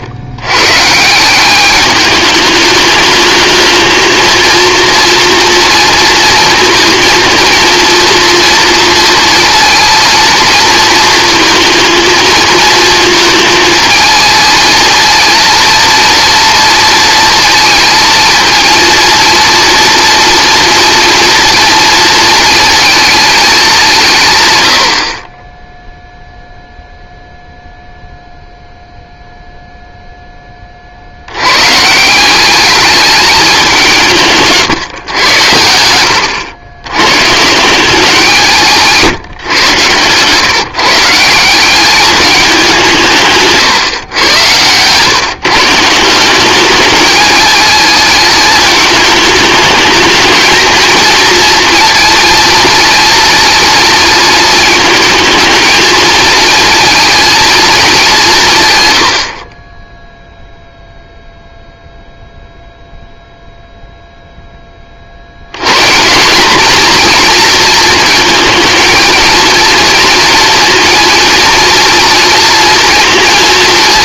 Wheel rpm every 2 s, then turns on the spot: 130, 210, 230, 220, 230, 230, 230, 230, 230, 230, 230, 230, 100, 0, 0, 40, 210, 140, 100, 170, 150, 180, 120, 200, 220, 230, 230, 230, 230, 120, 0, 0, 20, 230, 220, 230, 230.
34-36 38-40